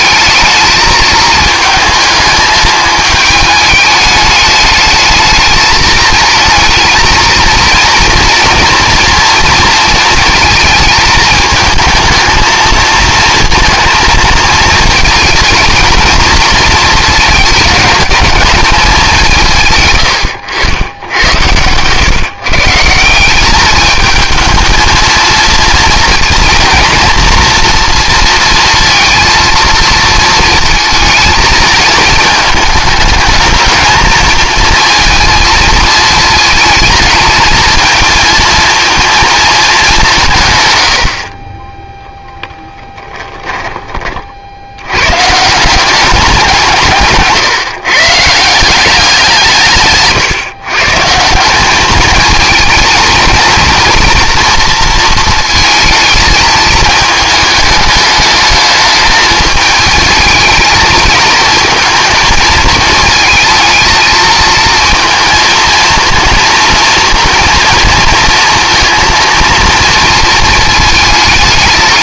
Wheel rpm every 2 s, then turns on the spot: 220, 220, 210, 220, 230, 230, 220, 230, 230, 210, 90, 150, 220, 230, 230, 220, 220, 230, 220, 230, 110, 10, 70, 170, 170, 140, 220, 230, 220, 210, 220, 230, 230, 230, 230, 220.
42-44